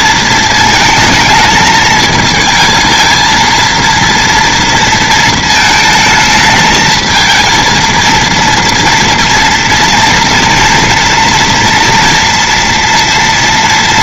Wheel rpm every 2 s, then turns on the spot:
220, 220, 230, 220, 230, 230, 230.
none